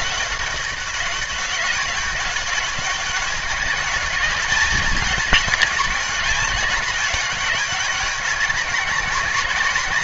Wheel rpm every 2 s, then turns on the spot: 200, 200, 200, 200, 190.
none